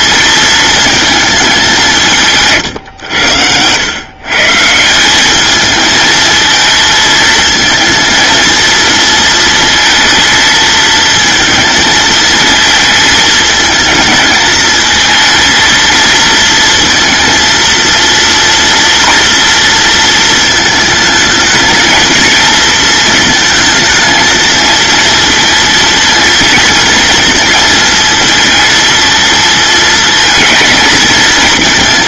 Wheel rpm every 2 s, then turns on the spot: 220, 100, 190, 220, 230, 220, 220, 220, 230, 230, 220, 220, 230, 230, 230, 220.
none